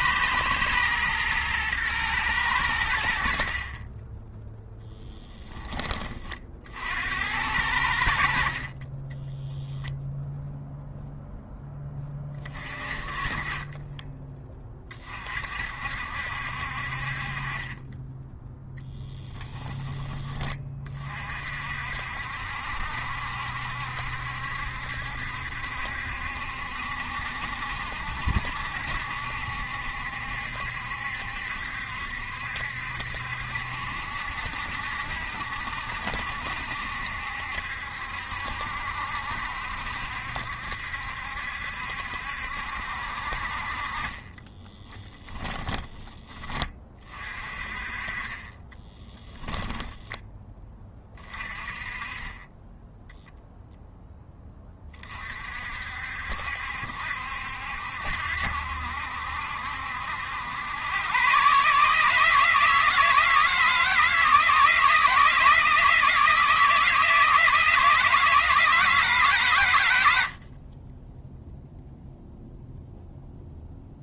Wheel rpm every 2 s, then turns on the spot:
120, 80, 10, 70, 30, 0, 30, 20, 50, 0, 30, 70, 70, 70, 70, 70, 70, 70, 70, 70, 70, 60, 10, 30, 20, 20, 10, 30, 70, 70, 110, 160, 160, 160, 160, 20, 0.
4-6 44-46 48-50